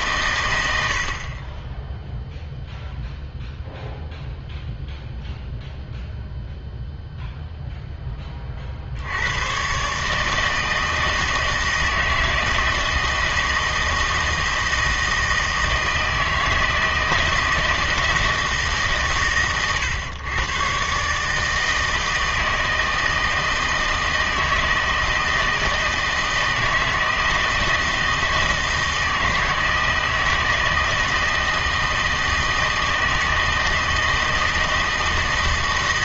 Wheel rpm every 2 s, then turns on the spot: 90, 0, 0, 0, 60, 160, 160, 160, 160, 150, 130, 160, 160, 160, 160, 160, 160, 160.
none